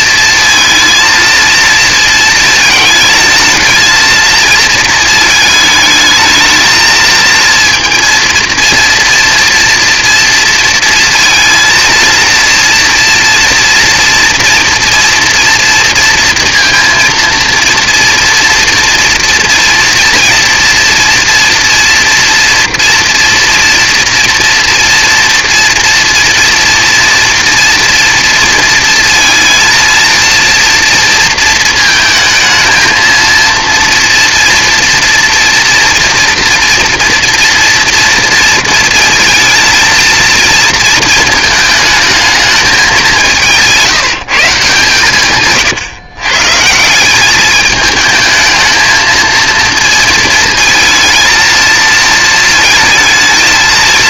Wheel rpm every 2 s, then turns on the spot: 230, 220, 230, 220, 230, 230, 230, 230, 230, 240, 230, 230, 230, 230, 230, 230, 230, 230, 230, 230, 230, 220, 160, 140, 220, 220, 220.
none